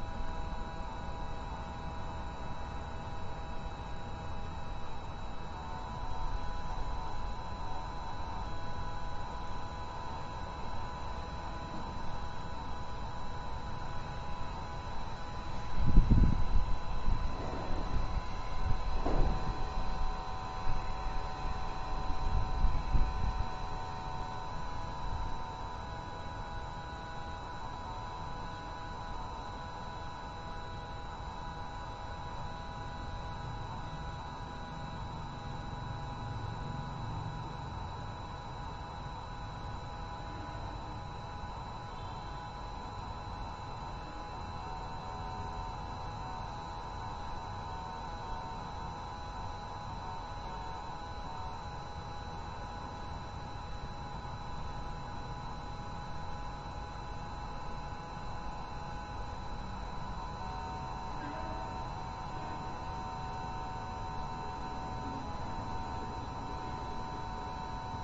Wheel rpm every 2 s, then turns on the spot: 0, 0, 0, 0, 0, 0, 0, 0, 0, 0, 0, 0, 0, 0, 0, 0, 0, 0, 0, 0, 0, 0, 0, 0, 0, 0, 0, 0, 0, 0, 0, 0, 0, 0.
none